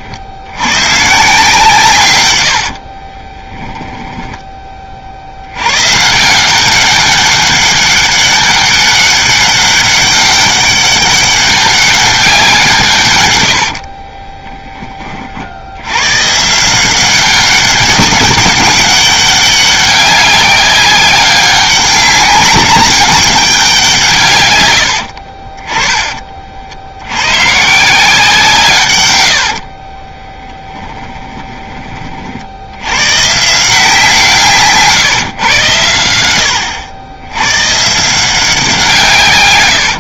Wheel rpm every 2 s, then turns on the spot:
130, 40, 30, 200, 200, 200, 150, 20, 170, 200, 190, 200, 100, 70, 140, 20, 100, 150, 90, 150.
2-4 30-32